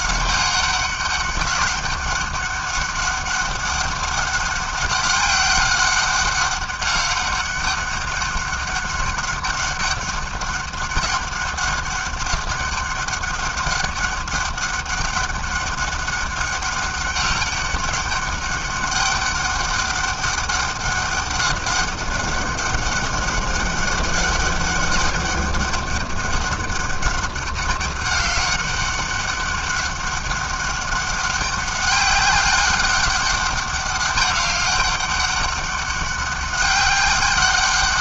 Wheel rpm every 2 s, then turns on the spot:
200, 200, 190, 200, 200, 190, 200, 200, 200, 200, 200, 200, 200, 200, 200, 200, 200, 200, 200.
none